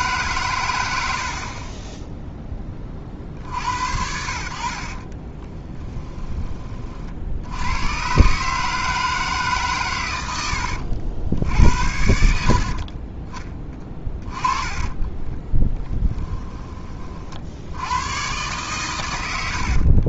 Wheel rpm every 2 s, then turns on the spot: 120, 20, 60, 30, 150, 80, 50, 20, 30, 120.
4-6 12-16